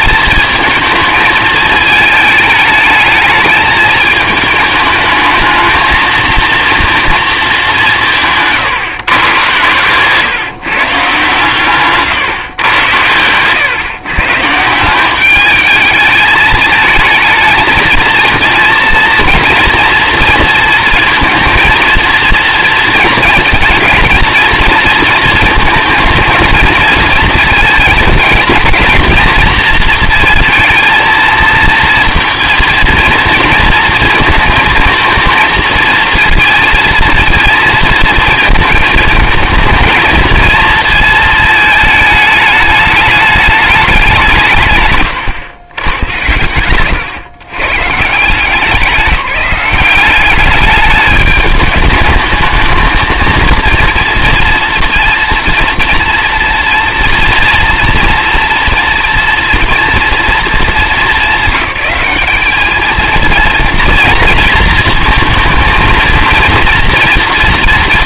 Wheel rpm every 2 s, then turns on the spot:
220, 220, 220, 230, 150, 150, 130, 150, 220, 230, 230, 230, 230, 220, 220, 230, 230, 230, 230, 220, 230, 210, 150, 110, 180, 210, 220, 230, 230, 230, 210, 220, 230, 230.
46-48